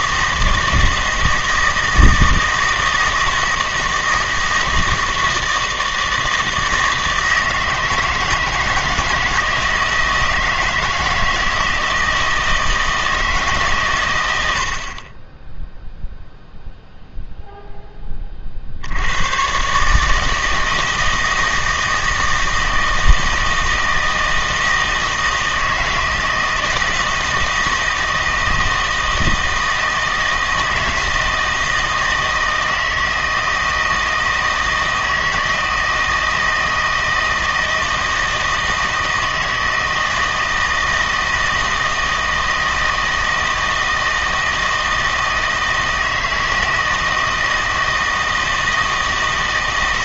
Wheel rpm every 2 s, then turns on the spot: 160, 160, 160, 160, 160, 160, 160, 80, 0, 60, 160, 160, 160, 160, 160, 160, 160, 160, 160, 160, 160, 160, 160, 160, 160.
none